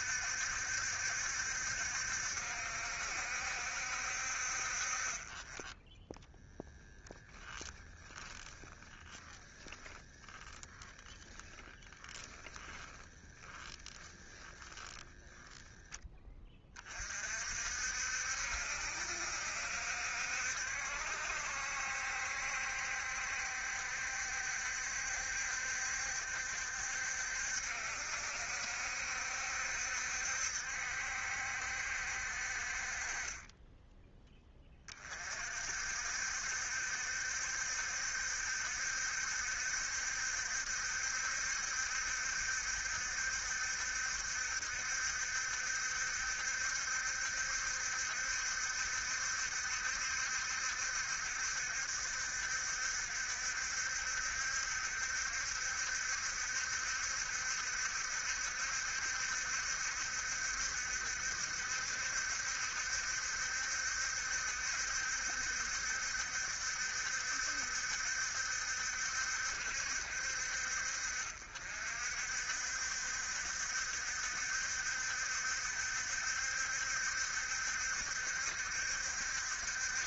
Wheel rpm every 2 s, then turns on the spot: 70, 70, 40, 10, 10, 10, 10, 20, 40, 60, 70, 70, 70, 70, 70, 70, 30, 30, 60, 70, 70, 70, 70, 70, 70, 70, 60, 70, 70, 70, 70, 70, 70, 70, 70, 60, 60, 60, 70, 70.
8-10 12-16